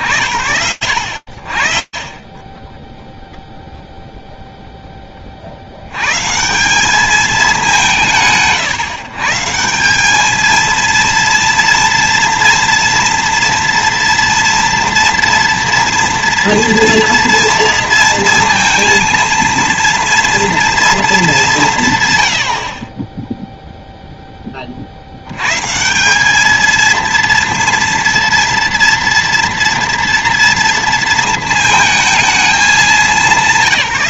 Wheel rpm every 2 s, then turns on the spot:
40, 0, 190, 130, 230, 240, 230, 230, 230, 230, 40, 20, 210, 230, 230, 220, 110.
none